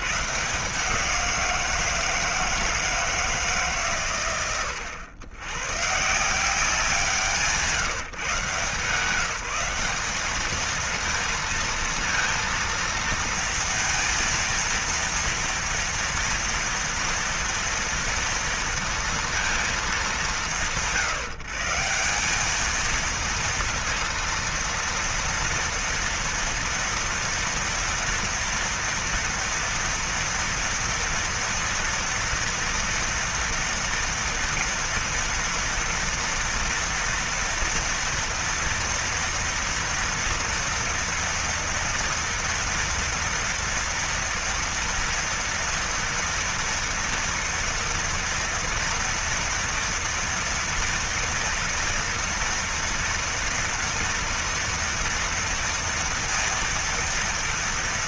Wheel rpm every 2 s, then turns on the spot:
120, 170, 110, 140, 150, 190, 230, 230, 230, 230, 190, 180, 230, 230, 230, 230, 230, 230, 230, 230, 230, 230, 230, 240, 240, 230, 230, 230, 230.
none